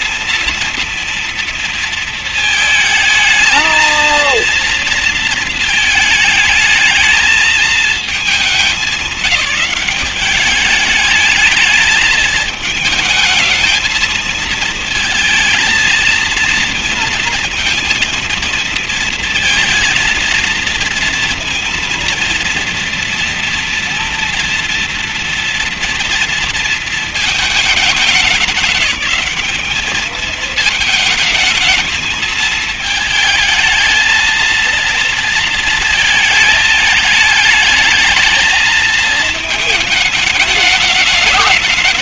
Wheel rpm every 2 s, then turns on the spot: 230, 220, 230, 220, 210, 200, 220, 220, 230, 230, 230, 230, 240, 230, 200, 220, 230, 220, 220, 220, 220.
none